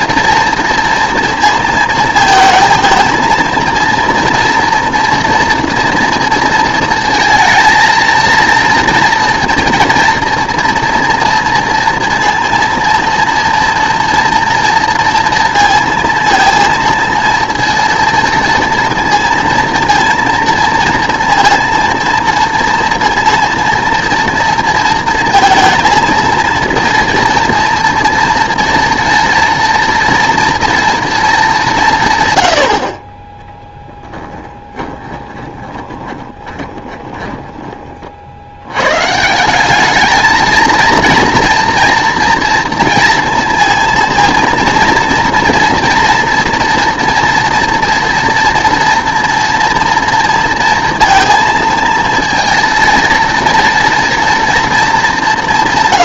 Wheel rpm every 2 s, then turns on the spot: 230, 220, 230, 230, 230, 230, 230, 230, 230, 230, 230, 230, 230, 230, 230, 230, 50, 10, 20, 100, 230, 230, 230, 230, 230, 230, 230, 220.
34-38